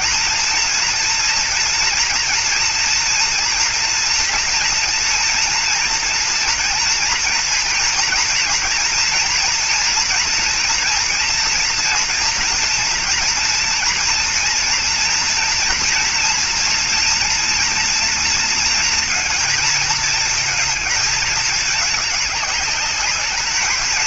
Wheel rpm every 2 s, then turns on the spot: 230, 230, 240, 240, 240, 230, 230, 230, 230, 230, 220, 210.
none